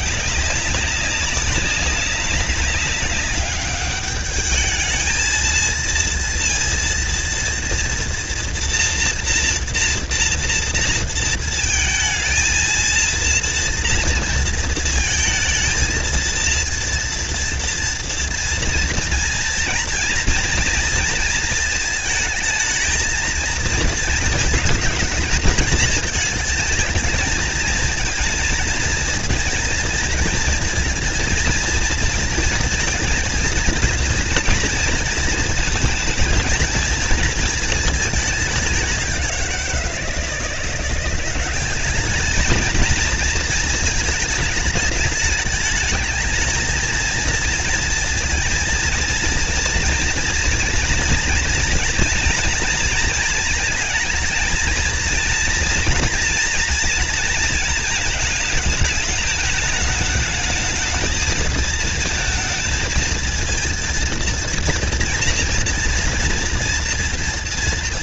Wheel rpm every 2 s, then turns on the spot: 200, 200, 220, 230, 230, 230, 230, 230, 230, 230, 230, 220, 210, 220, 230, 230, 230, 230, 230, 190, 190, 220, 210, 230, 230, 230, 230, 230, 230, 210, 220, 220, 240, 230.
none